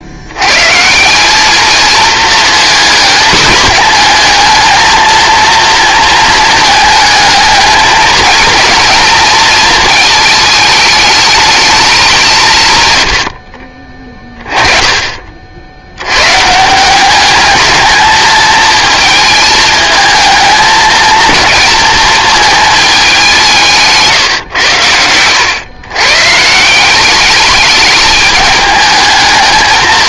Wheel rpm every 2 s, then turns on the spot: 150, 230, 220, 220, 230, 220, 120, 30, 170, 220, 210, 210, 100, 180, 210.
none